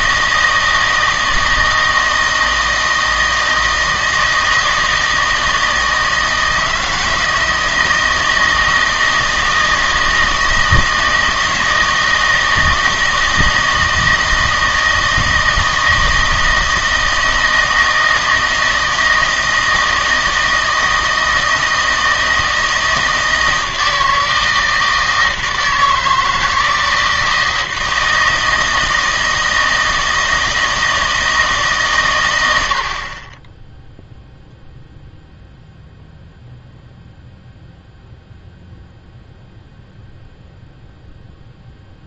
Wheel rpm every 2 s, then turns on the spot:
160, 160, 160, 160, 160, 160, 160, 160, 160, 160, 160, 160, 160, 160, 160, 160, 90, 0, 0, 0, 0.
none